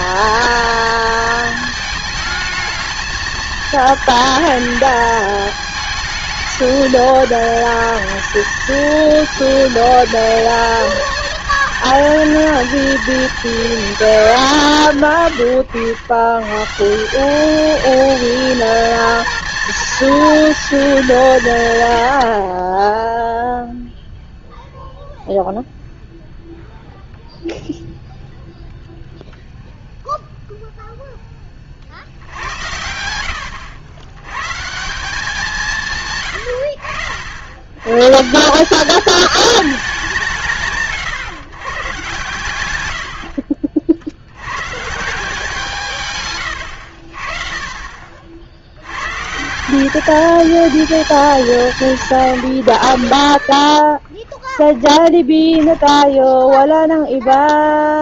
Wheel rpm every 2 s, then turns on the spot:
230, 220, 210, 210, 220, 220, 220, 160, 140, 230, 220, 20, 0, 0, 0, 0, 80, 160, 80, 200, 150, 100, 130, 90, 90, 220, 90, 10, 10.
42-44